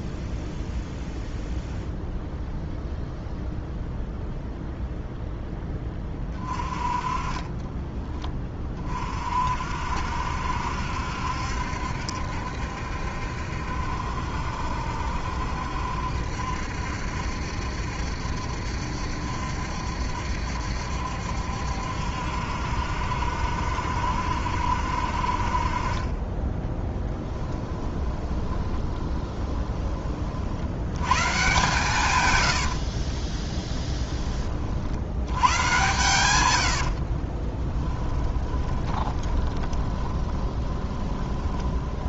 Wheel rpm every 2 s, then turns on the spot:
0, 0, 0, 30, 40, 70, 70, 70, 70, 70, 70, 70, 60, 10, 20, 110, 60, 70, 60, 20, 20.
26-30 32-34 36-42